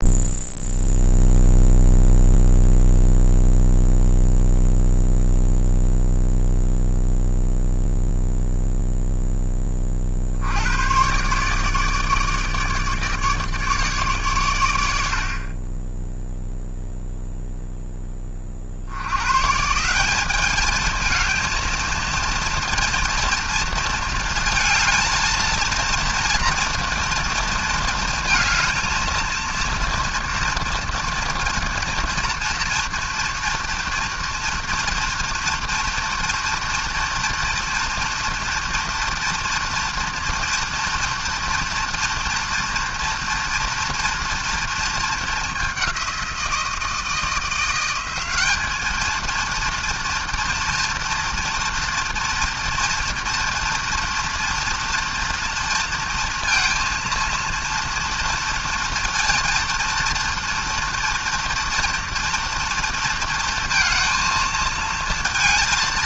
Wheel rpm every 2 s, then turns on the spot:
0, 0, 0, 0, 0, 110, 150, 90, 0, 80, 220, 230, 230, 240, 230, 230, 230, 230, 230, 230, 230, 230, 220, 170, 210, 230, 230, 230, 230, 230, 230, 230, 220.
none